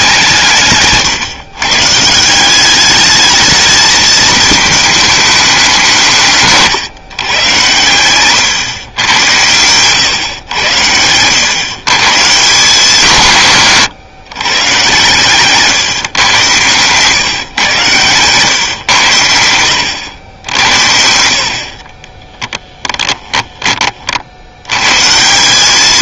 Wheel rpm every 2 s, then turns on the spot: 150, 200, 220, 150, 130, 100, 160, 120, 130, 120, 80, 10, 100.
16-18 22-24